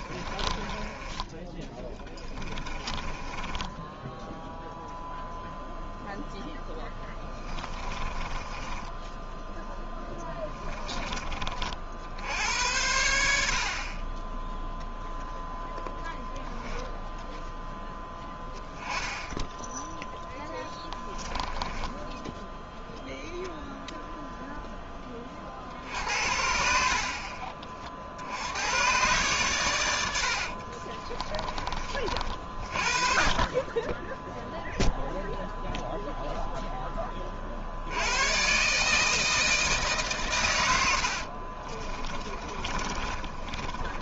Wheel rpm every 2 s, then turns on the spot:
20, 20, 0, 10, 10, 20, 90, 0, 0, 10, 10, 0, 0, 60, 110, 30, 30, 0, 10, 140, 100, 30.
0-4 8-10 20-22 30-32 42-44